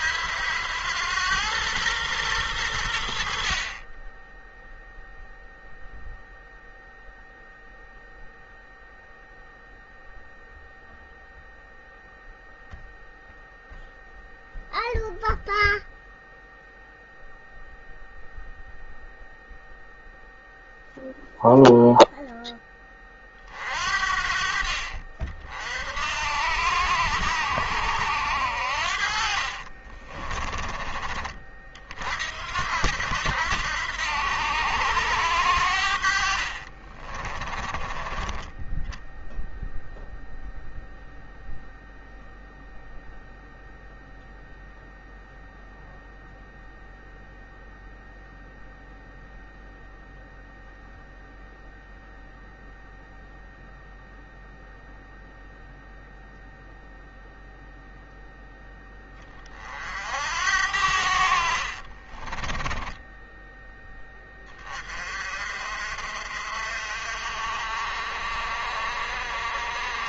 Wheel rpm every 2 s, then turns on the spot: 90, 100, 10, 0, 0, 0, 0, 0, 0, 0, 0, 10, 50, 80, 80, 30, 70, 90, 50, 20, 0, 0, 0, 0, 0, 0, 0, 0, 0, 0, 70, 20, 20, 50, 50.
36-38 62-64